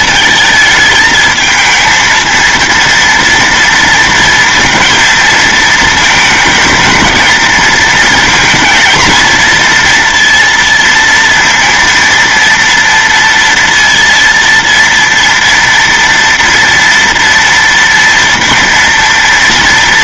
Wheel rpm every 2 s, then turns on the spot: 220, 230, 230, 220, 230, 230, 230, 230, 230, 230.
none